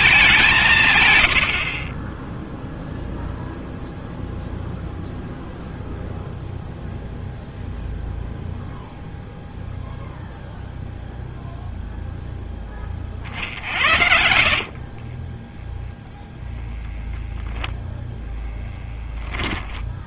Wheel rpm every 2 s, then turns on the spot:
180, 0, 0, 0, 0, 0, 20, 50, 10, 10.
14-16